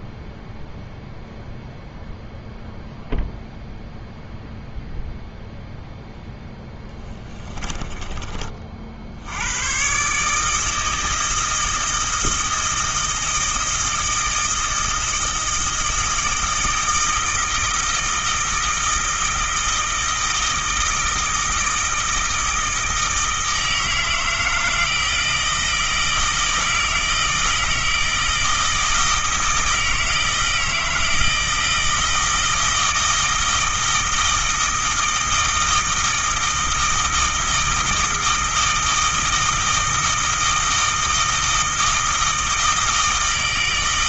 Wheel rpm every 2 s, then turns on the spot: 0, 0, 0, 10, 60, 160, 160, 160, 160, 160, 160, 160, 160, 160, 160, 160, 160, 160, 160, 160, 160, 160.
6-8